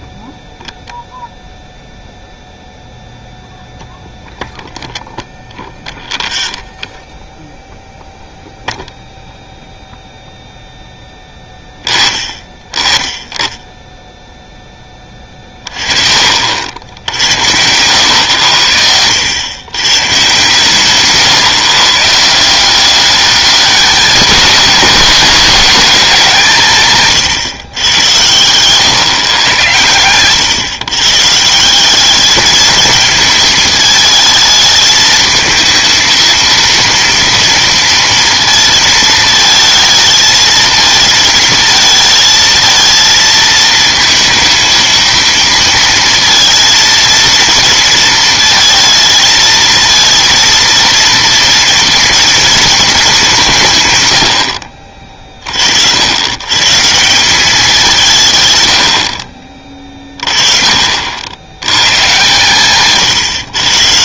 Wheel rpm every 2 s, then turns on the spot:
0, 0, 0, 0, 0, 0, 20, 10, 60, 90, 140, 190, 230, 170, 120, 120, 210, 220, 230, 230, 220, 220, 230, 230, 230, 230, 230, 50, 130, 110, 40, 140.
none